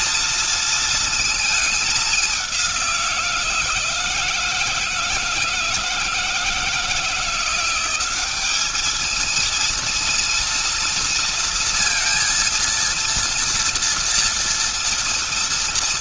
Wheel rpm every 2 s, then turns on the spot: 230, 190, 160, 160, 200, 230, 230, 230.
none